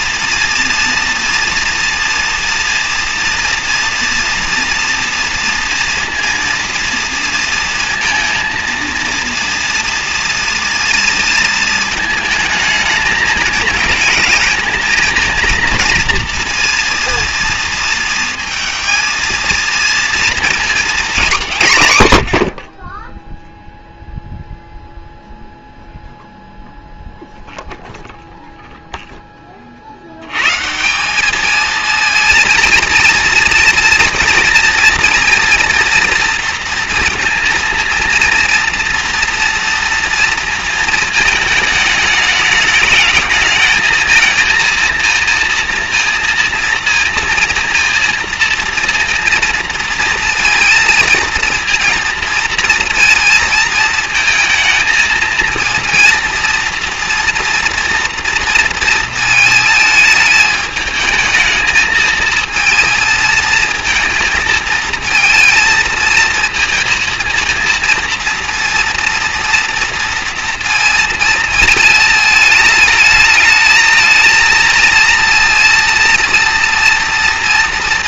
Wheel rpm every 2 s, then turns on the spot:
230, 230, 240, 230, 230, 230, 220, 220, 230, 220, 230, 70, 0, 0, 0, 140, 220, 230, 230, 230, 230, 220, 230, 230, 230, 230, 230, 220, 230, 230, 210, 230, 230, 230, 230, 230, 210, 230, 230.
none